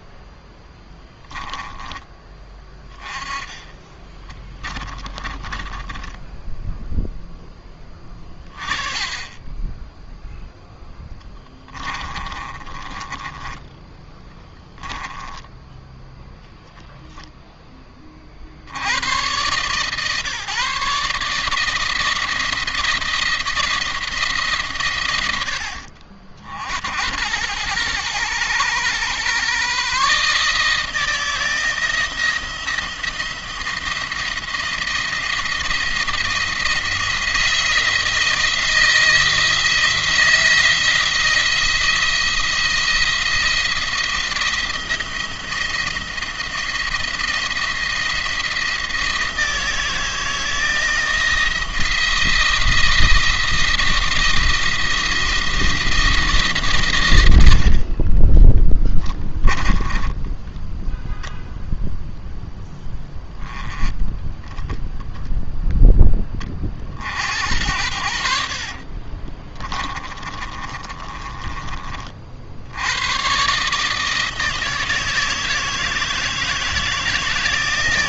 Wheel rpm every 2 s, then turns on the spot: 10, 20, 20, 10, 20, 0, 30, 10, 0, 70, 140, 170, 140, 70, 120, 150, 170, 170, 170, 170, 170, 170, 170, 170, 170, 160, 170, 170, 130, 20, 10, 0, 10, 40, 60, 20, 80, 160, 160.
0-2 4-8 12-16 58-60 68-72